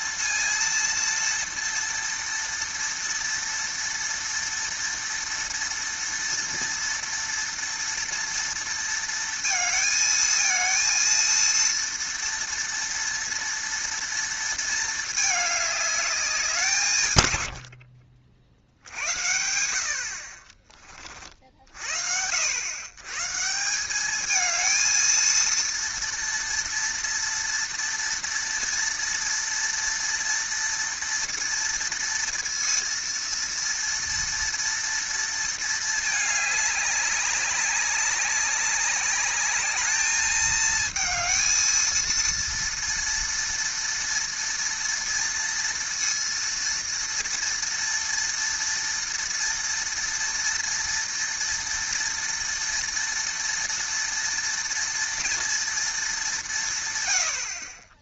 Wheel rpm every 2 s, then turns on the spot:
230, 230, 230, 230, 230, 230, 240, 230, 190, 50, 40, 90, 220, 230, 230, 230, 230, 230, 210, 200, 220, 230, 230, 230, 230, 240, 230, 230, 190.
none